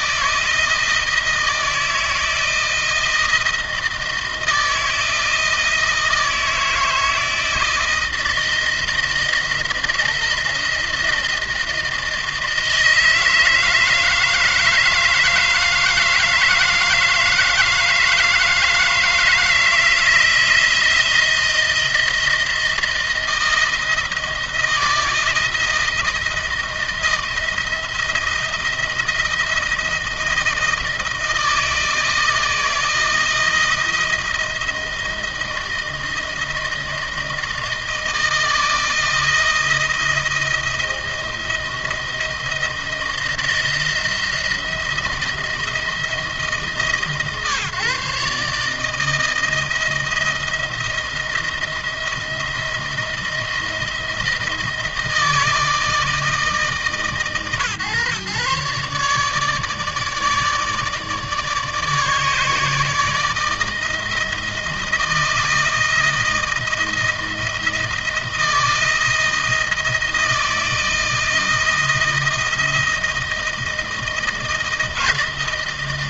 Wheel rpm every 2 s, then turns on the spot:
160, 160, 160, 160, 160, 160, 160, 160, 160, 160, 170, 170, 160, 170, 170, 160, 160, 160, 160, 160, 160, 160, 170, 150, 160, 170, 170, 160, 150, 150, 150, 150, 160, 160, 160, 160, 160, 160.
none